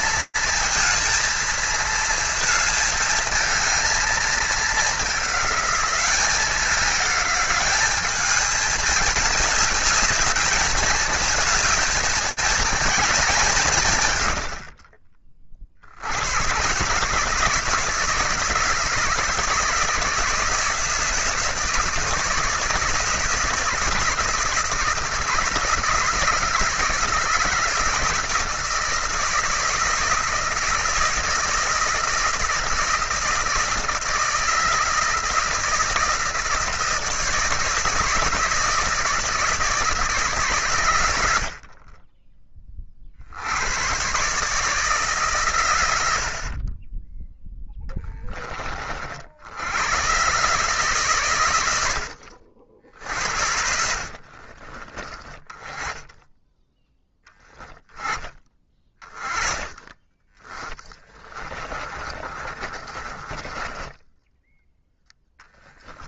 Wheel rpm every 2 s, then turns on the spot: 230, 220, 210, 200, 210, 220, 220, 50, 150, 160, 160, 160, 160, 160, 160, 160, 170, 160, 160, 160, 110, 40, 160, 30, 40, 140, 70, 30, 10, 20, 20, 30, 10.
46-48 54-56 60-64